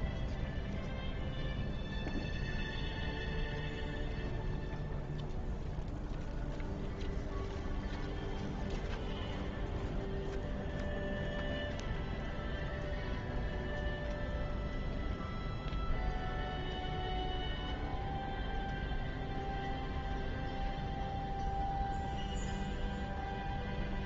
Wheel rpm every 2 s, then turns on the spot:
0, 0, 0, 0, 0, 0, 0, 0, 0, 0, 0, 0.
none